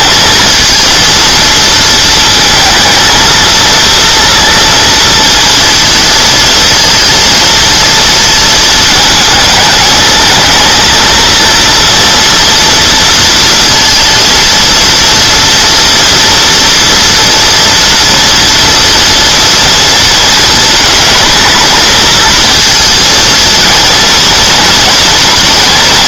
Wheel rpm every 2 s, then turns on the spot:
230, 230, 230, 230, 220, 230, 230, 230, 230, 230, 230, 230, 230.
none